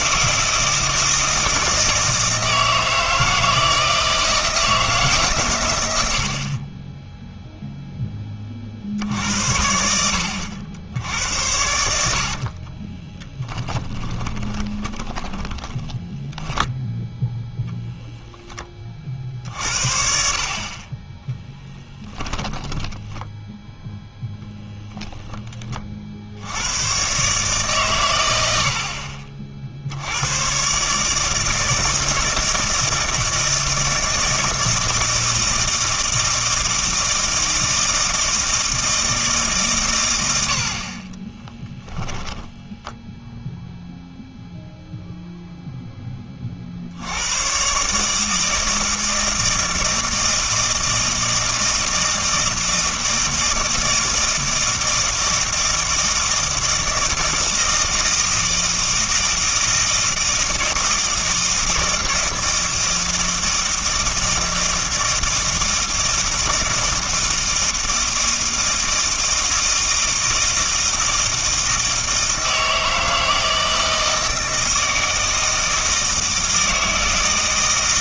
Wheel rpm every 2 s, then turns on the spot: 160, 160, 160, 50, 40, 80, 40, 20, 0, 10, 40, 10, 0, 80, 80, 120, 160, 160, 160, 160, 80, 0, 0, 40, 160, 160, 160, 160, 160, 160, 160, 160, 160, 160, 160, 160, 160, 160, 160.
12-16 22-24